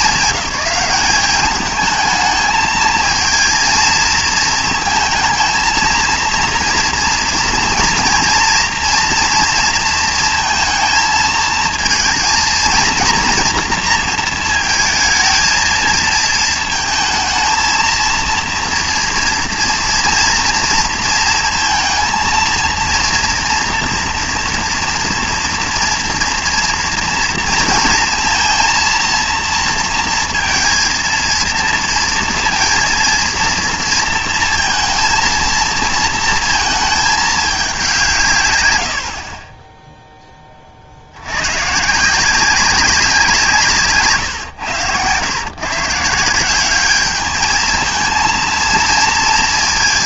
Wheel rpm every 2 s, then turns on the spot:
190, 220, 220, 230, 230, 230, 230, 220, 230, 230, 230, 230, 230, 230, 230, 230, 230, 230, 220, 100, 50, 190, 110, 190, 230.
none